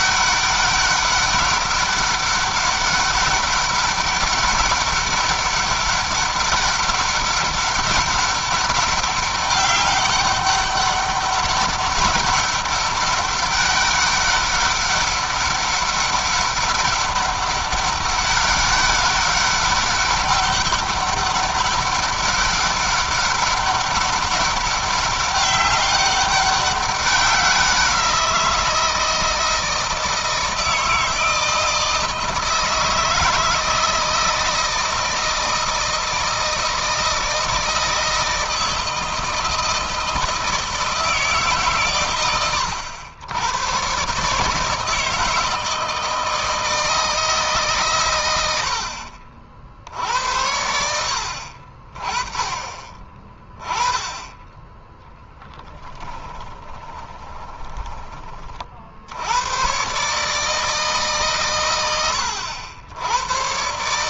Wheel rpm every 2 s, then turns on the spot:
200, 200, 200, 200, 200, 200, 200, 200, 200, 200, 200, 200, 200, 200, 170, 160, 160, 160, 160, 160, 160, 100, 160, 160, 70, 70, 30, 10, 20, 50, 150, 80.
56-58